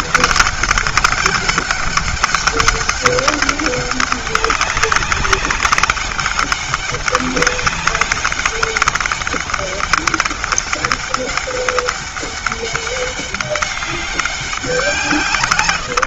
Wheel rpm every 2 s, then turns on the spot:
200, 200, 200, 200, 200, 200, 200, 150.
none